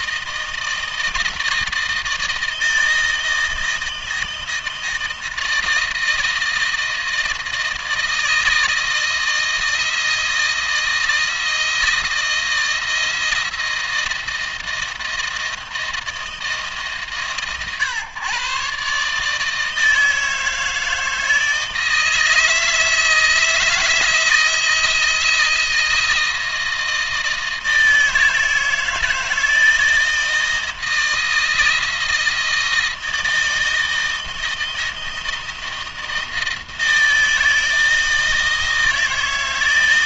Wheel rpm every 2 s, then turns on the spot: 160, 160, 160, 160, 160, 160, 160, 160, 150, 130, 160, 160, 170, 160, 160, 160, 160, 160, 160, 160.
none